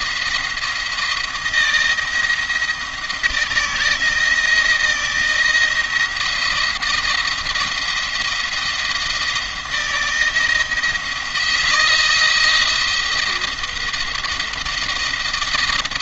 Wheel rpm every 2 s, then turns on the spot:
160, 170, 160, 160, 170, 160, 170, 170.
none